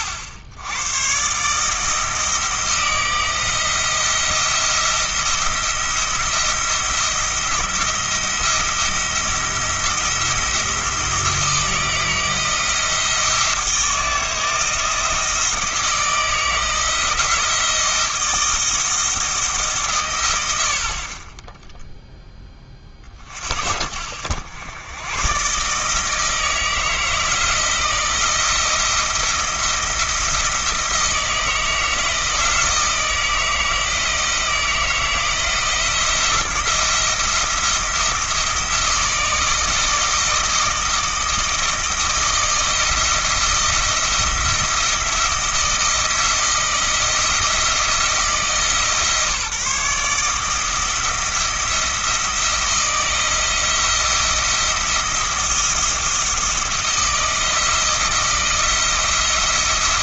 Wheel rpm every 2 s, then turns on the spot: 90, 160, 170, 170, 170, 160, 160, 160, 160, 160, 70, 30, 100, 160, 160, 160, 160, 170, 170, 160, 160, 160, 170, 160, 140, 160, 170, 170, 160, 160.
none